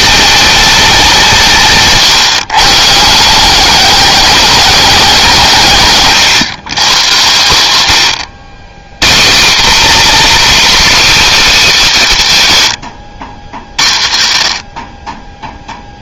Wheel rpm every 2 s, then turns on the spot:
220, 160, 200, 130, 160, 300, 130, 50.
none